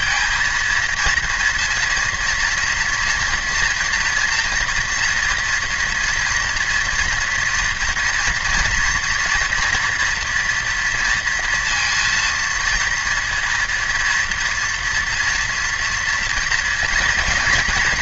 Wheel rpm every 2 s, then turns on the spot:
230, 230, 240, 240, 230, 230, 230, 230, 230.
none